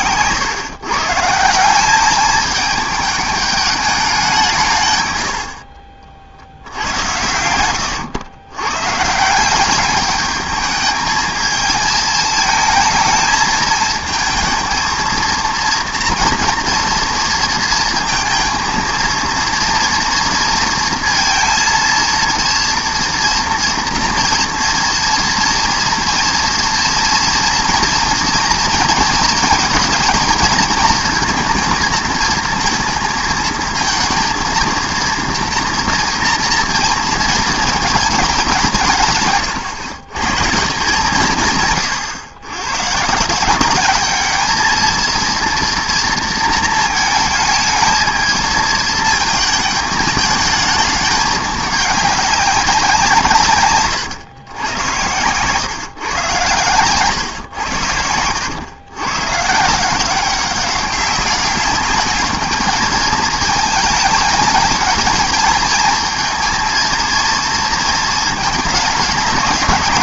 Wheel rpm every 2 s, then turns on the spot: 120, 210, 170, 70, 110, 210, 220, 220, 230, 230, 230, 230, 230, 230, 230, 220, 230, 230, 230, 190, 150, 110, 220, 220, 220, 220, 200, 110, 120, 100, 190, 210, 210, 220, 220.
none